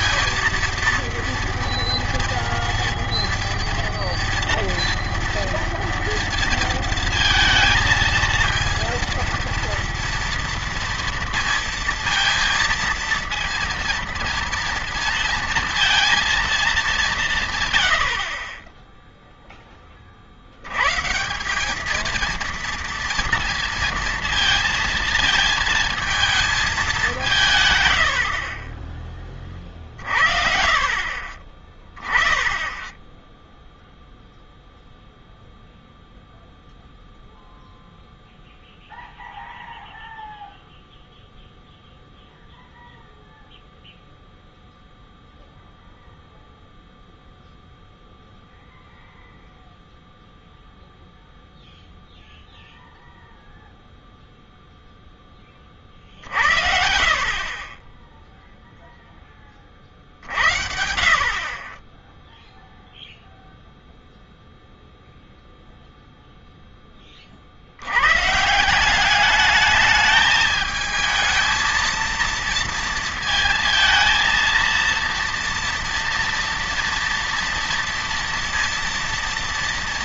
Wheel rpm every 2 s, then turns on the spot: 230, 230, 230, 230, 230, 230, 230, 230, 200, 10, 110, 230, 230, 210, 30, 30, 0, 0, 0, 0, 0, 0, 0, 0, 0, 0, 0, 0, 60, 0, 70, 0, 0, 10, 170, 220, 230, 230, 230, 230.
none